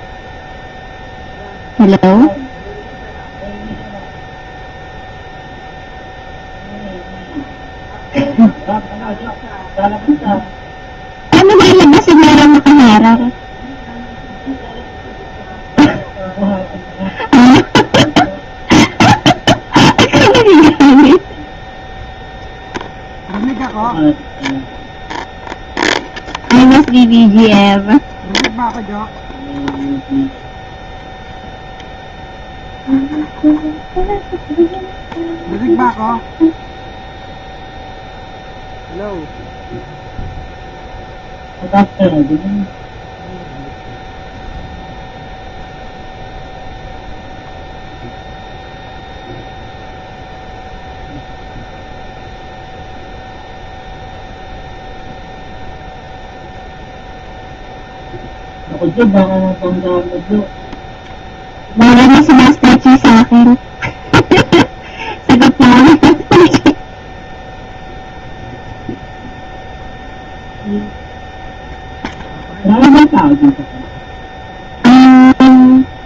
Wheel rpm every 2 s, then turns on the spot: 0, 0, 0, 0, 0, 0, 0, 0, 0, 0, 0, 0, 0, 0, 0, 0, 0, 0, 0, 0, 0, 0, 0, 0, 0, 0, 0, 0, 0, 0, 0, 0, 0, 0, 0, 0, 0, 0.
none